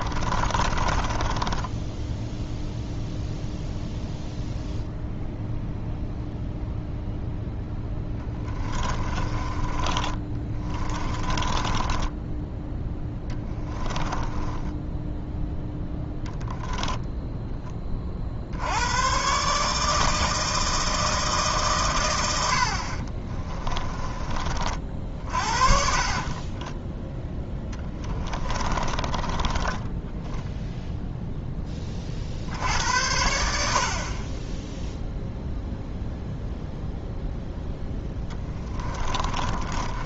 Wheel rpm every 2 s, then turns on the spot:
30, 0, 0, 0, 20, 20, 10, 10, 0, 80, 160, 70, 40, 20, 20, 0, 70, 10, 0, 20.
0-2 8-12 14-16 26-30 38-40